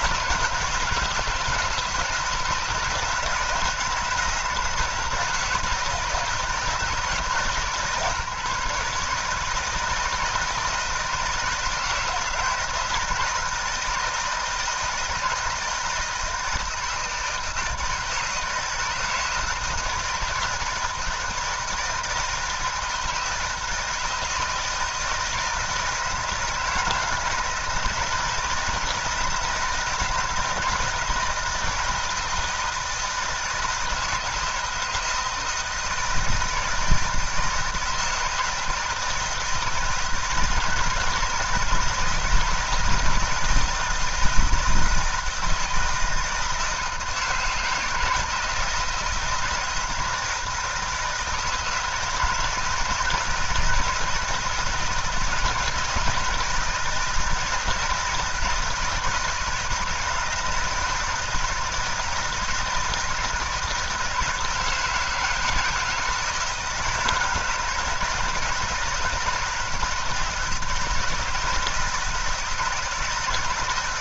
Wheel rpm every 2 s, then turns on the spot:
160, 160, 170, 160, 150, 160, 160, 160, 160, 160, 160, 170, 160, 160, 170, 160, 160, 160, 160, 170, 160, 160, 160, 160, 160, 160, 160, 160, 170, 160, 160, 160, 160, 160, 160, 160, 160.
none